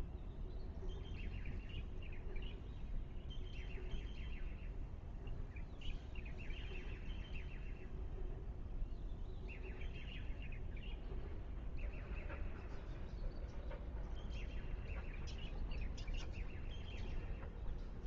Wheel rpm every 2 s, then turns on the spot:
0, 0, 0, 0, 0, 0, 0, 0, 0.
none